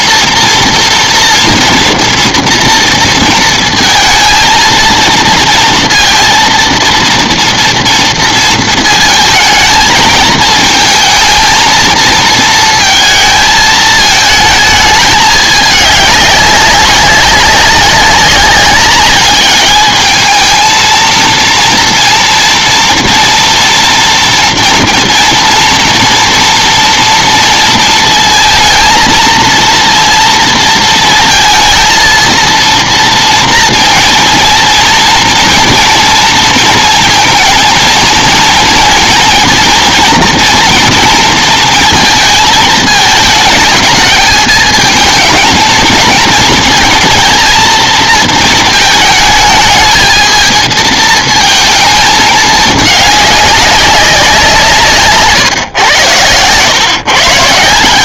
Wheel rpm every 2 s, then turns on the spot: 230, 230, 230, 230, 230, 220, 220, 210, 200, 200, 220, 230, 230, 230, 230, 230, 230, 230, 230, 230, 230, 220, 220, 220, 220, 230, 210, 160, 120.
none